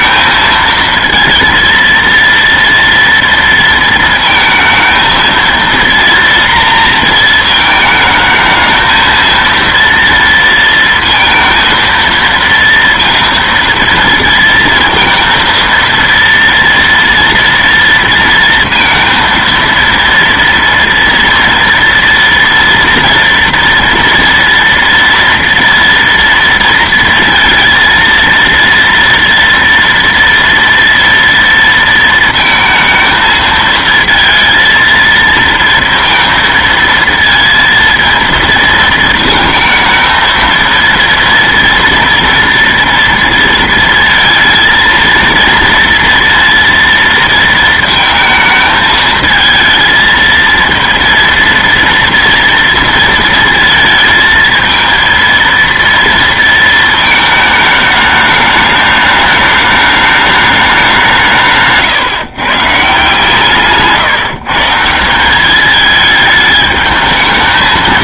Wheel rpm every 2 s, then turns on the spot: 230, 230, 220, 230, 220, 230, 230, 230, 230, 230, 230, 230, 230, 230, 230, 230, 230, 220, 230, 230, 220, 240, 230, 230, 220, 230, 230, 220, 230, 210, 210, 140, 150, 210.
none